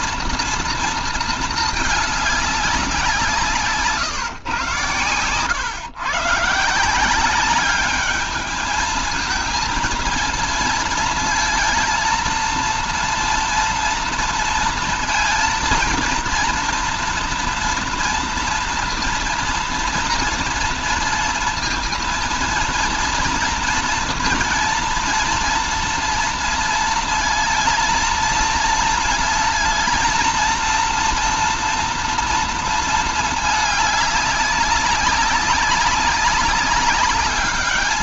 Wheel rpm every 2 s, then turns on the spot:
230, 200, 130, 140, 210, 230, 230, 230, 230, 230, 230, 230, 230, 230, 230, 230, 230, 200, 200.
none